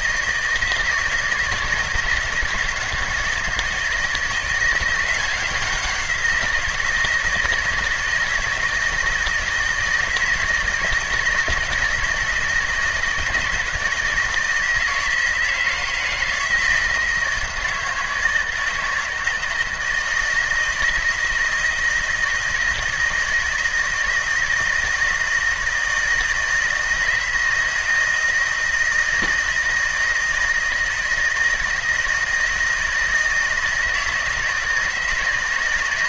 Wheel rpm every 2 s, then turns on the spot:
160, 160, 170, 170, 160, 160, 160, 160, 160, 160, 160, 160, 160, 160, 160, 160, 160, 160.
none